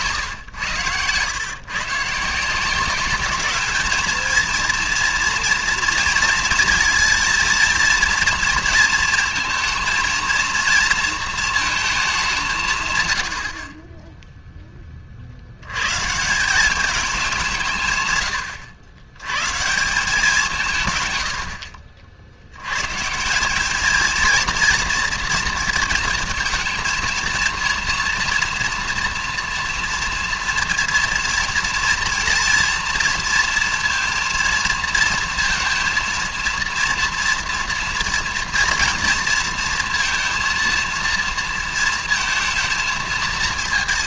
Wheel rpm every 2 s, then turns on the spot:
120, 180, 230, 230, 230, 230, 160, 10, 190, 100, 150, 110, 230, 220, 230, 230, 230, 230, 230, 230, 230, 230.
none